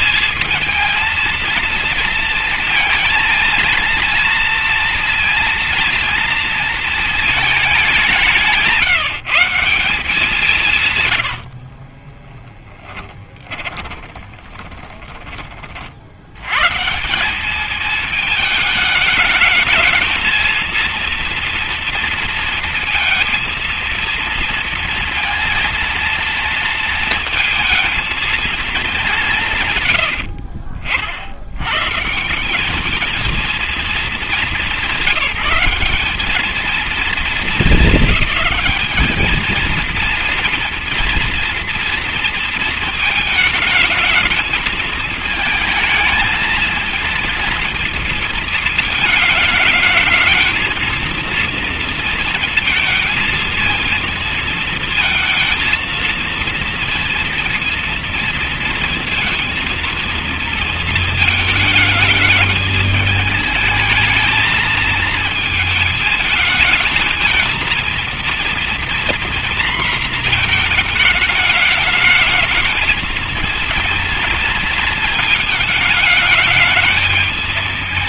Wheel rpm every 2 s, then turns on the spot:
220, 230, 230, 230, 170, 150, 10, 20, 110, 220, 230, 230, 230, 230, 220, 70, 200, 180, 210, 210, 230, 230, 220, 220, 230, 230, 230, 230, 230, 230, 230, 220, 230, 220, 230, 220, 220, 220, 210.
12-16 30-32